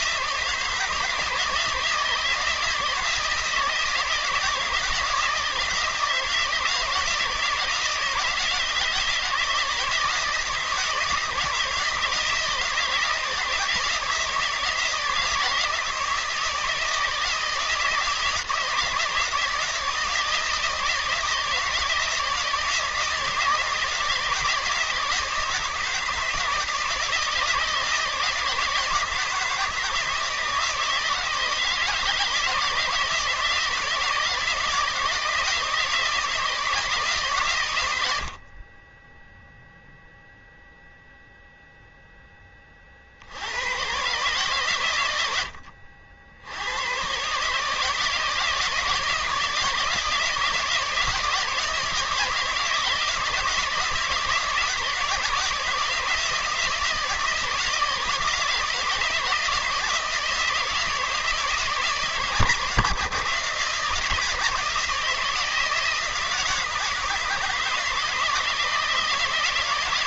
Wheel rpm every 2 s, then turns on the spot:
160, 160, 160, 160, 160, 160, 160, 160, 160, 160, 160, 160, 160, 160, 160, 160, 160, 160, 160, 20, 0, 50, 110, 110, 160, 160, 160, 160, 170, 160, 160, 150, 160, 160, 160.
none